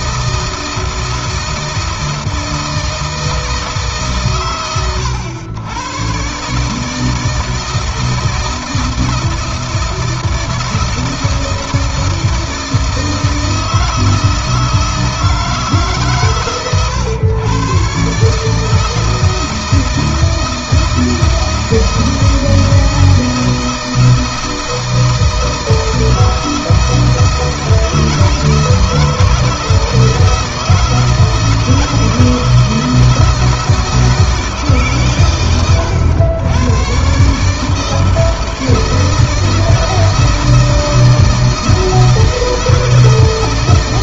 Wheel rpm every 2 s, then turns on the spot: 160, 160, 100, 160, 160, 160, 160, 160, 120, 160, 160, 170, 160, 160, 160, 160, 170, 130, 120, 160, 160, 160.
none